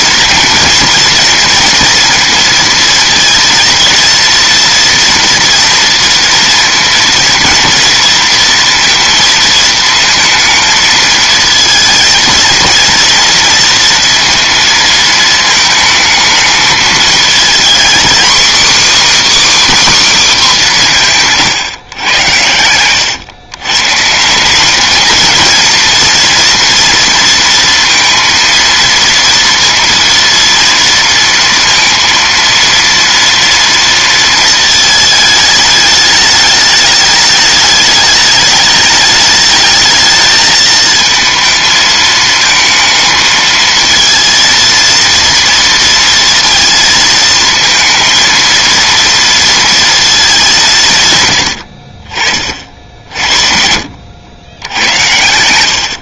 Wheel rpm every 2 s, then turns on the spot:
230, 230, 230, 230, 230, 220, 230, 220, 220, 290, 170, 100, 220, 230, 230, 230, 230, 220, 210, 210, 220, 220, 230, 220, 230, 140, 60, 80.
50-52